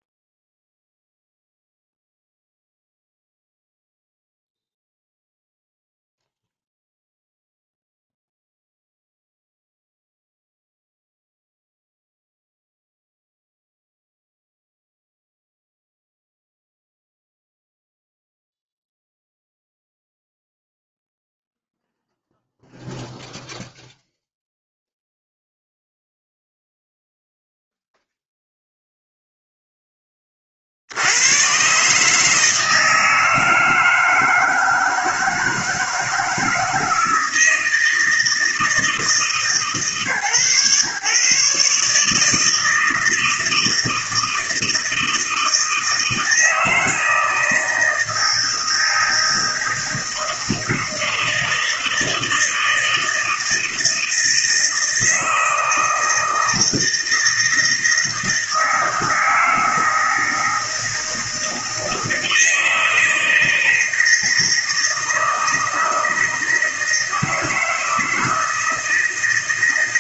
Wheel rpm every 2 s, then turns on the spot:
0, 0, 0, 0, 0, 0, 0, 0, 0, 0, 0, 0, 0, 0, 0, 70, 160, 160, 160, 160, 130, 160, 160, 160, 160, 160, 160, 160, 160, 160, 160, 160, 160, 160, 170.
none